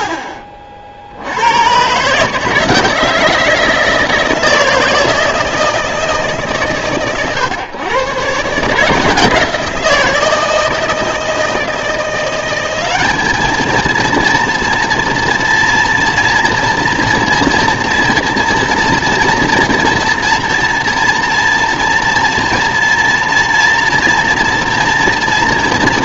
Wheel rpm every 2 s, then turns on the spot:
50, 160, 160, 130, 160, 160, 200, 230, 230, 230, 230, 230, 230.
none